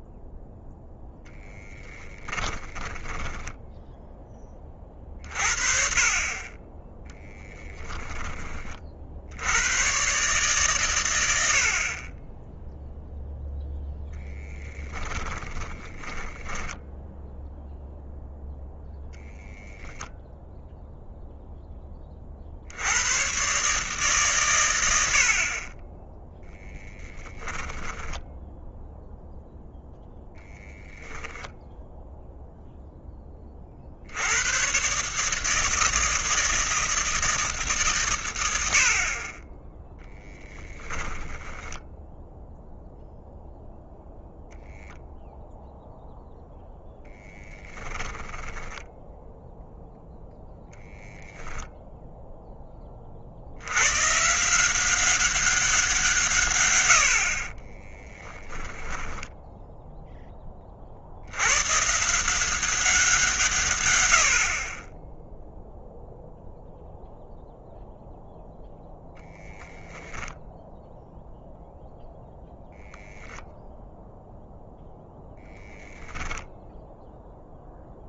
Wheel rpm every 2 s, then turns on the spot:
0, 10, 30, 10, 40, 120, 0, 20, 10, 0, 0, 90, 110, 10, 0, 10, 0, 130, 160, 60, 10, 0, 0, 0, 10, 0, 30, 180, 90, 10, 60, 180, 30, 0, 0, 0, 0, 0, 0.
2-4 14-18 26-28 30-32 40-42 48-50 58-60